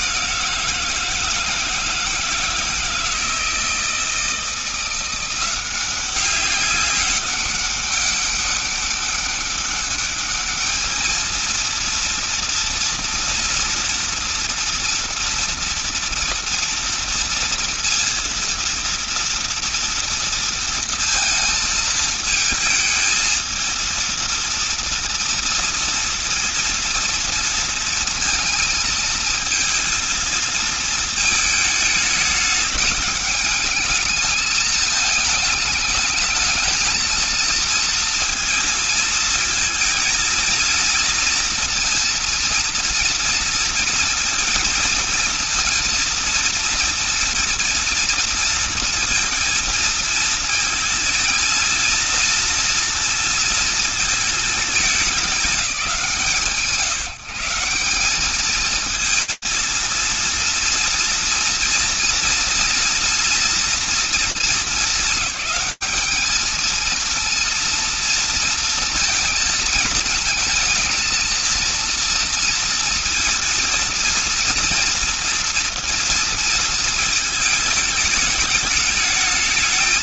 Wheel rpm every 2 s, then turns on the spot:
180, 160, 160, 190, 200, 210, 230, 230, 230, 230, 230, 220, 230, 230, 230, 230, 210, 210, 220, 230, 230, 230, 230, 230, 230, 230, 230, 220, 150, 200, 230, 230, 230, 210, 230, 230, 230, 230, 230, 220.
none